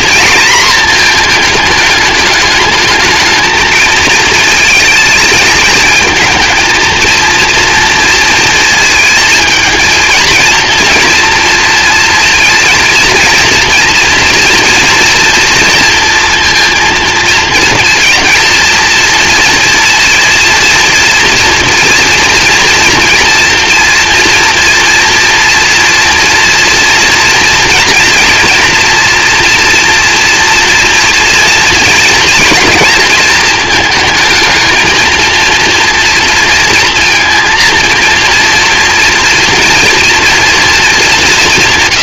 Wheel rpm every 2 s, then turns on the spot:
230, 210, 220, 220, 230, 230, 230, 230, 230, 230, 230, 230, 240, 230, 230, 230, 230, 220, 230, 230, 230.
none